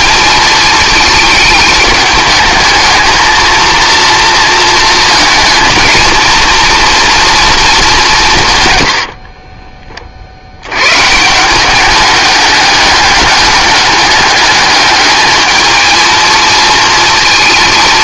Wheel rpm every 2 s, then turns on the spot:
220, 220, 230, 230, 110, 90, 200, 200, 230.
none